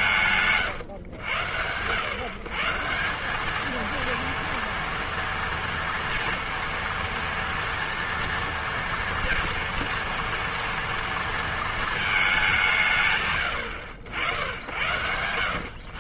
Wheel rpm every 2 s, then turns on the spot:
120, 190, 230, 230, 230, 230, 140, 90.
none